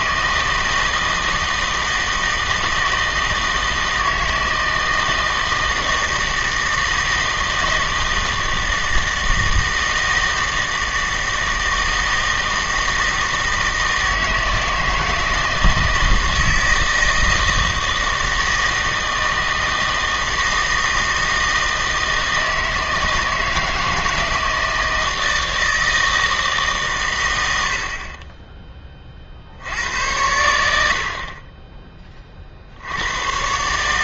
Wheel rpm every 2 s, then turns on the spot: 160, 160, 160, 160, 160, 160, 160, 160, 160, 160, 160, 160, 160, 150, 20, 80, 60.
none